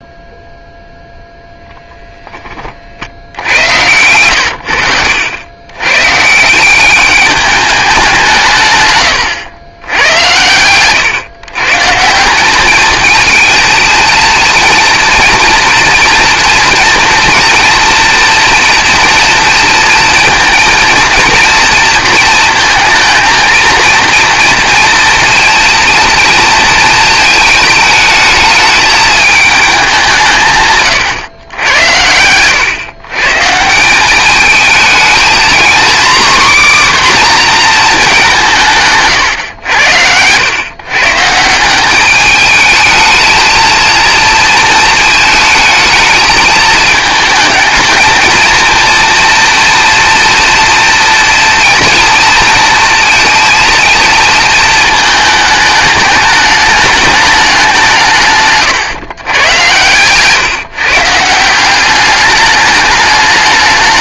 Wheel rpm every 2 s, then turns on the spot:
0, 60, 90, 200, 140, 120, 210, 230, 230, 240, 230, 220, 230, 230, 220, 130, 130, 220, 260, 140, 130, 220, 230, 220, 230, 240, 230, 220, 210, 130, 150, 210.
none